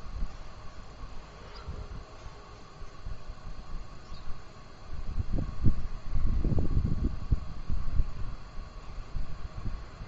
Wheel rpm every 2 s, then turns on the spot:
0, 0, 0, 0, 0.
none